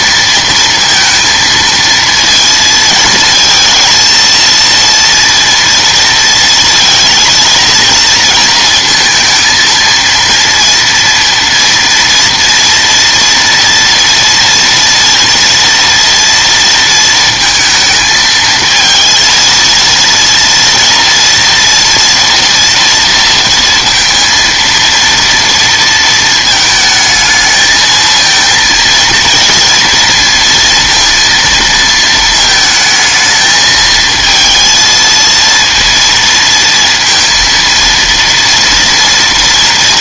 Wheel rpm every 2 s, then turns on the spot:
230, 230, 230, 230, 230, 230, 230, 230, 230, 220, 230, 230, 230, 220, 220, 230, 220, 230, 230, 230.
none